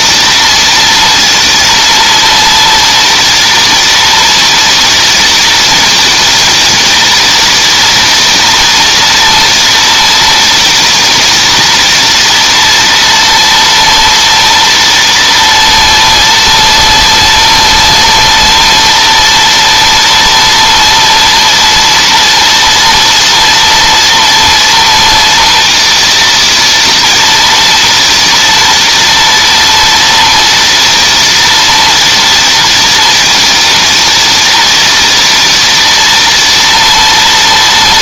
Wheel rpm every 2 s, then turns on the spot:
240, 230, 240, 230, 230, 230, 230, 230, 230, 230, 230, 230, 230, 230, 230, 230, 240, 230, 230.
none